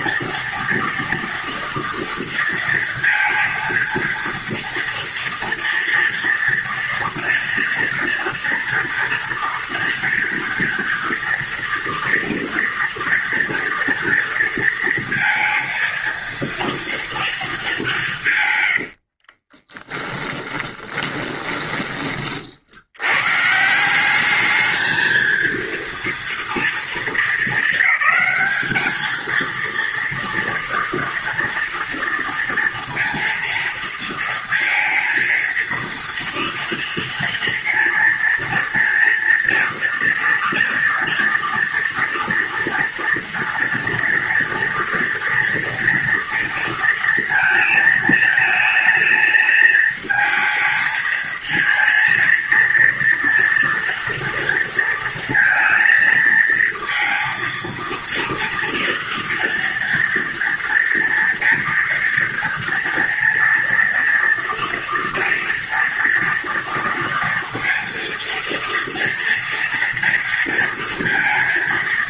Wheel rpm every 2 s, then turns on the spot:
230, 230, 230, 230, 240, 230, 240, 230, 230, 140, 10, 40, 200, 230, 210, 230, 230, 230, 230, 230, 240, 230, 230, 230, 220, 220, 230, 230, 220, 230, 230, 230, 230, 230, 230, 230.
18-22